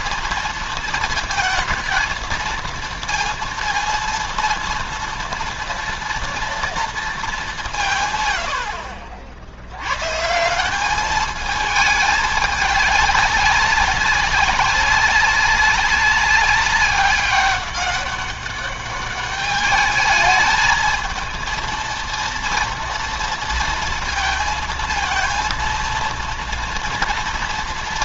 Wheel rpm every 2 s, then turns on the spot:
230, 230, 230, 230, 70, 170, 200, 190, 200, 200, 220, 230, 230, 230.
none